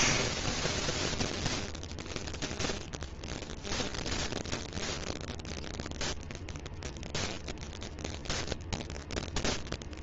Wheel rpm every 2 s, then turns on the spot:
0, 0, 0, 0, 0.
none